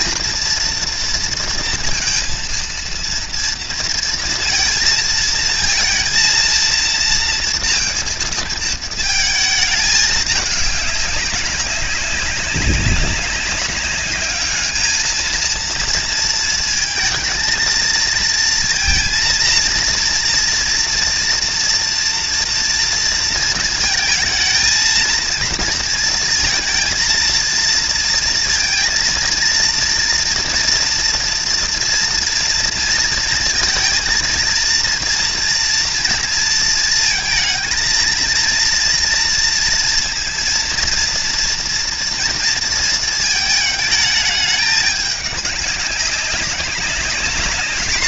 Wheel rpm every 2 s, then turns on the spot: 230, 230, 220, 230, 220, 200, 200, 220, 220, 230, 230, 230, 230, 230, 230, 230, 230, 230, 220, 230, 230, 230, 210, 200.
none